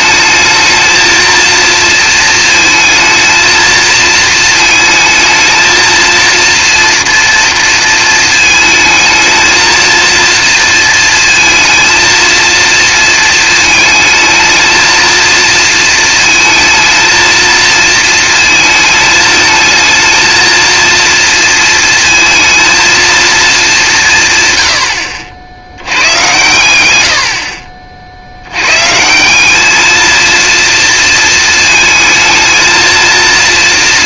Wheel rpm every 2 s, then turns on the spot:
220, 230, 230, 230, 220, 230, 230, 230, 220, 220, 230, 230, 100, 100, 130, 230, 230.
none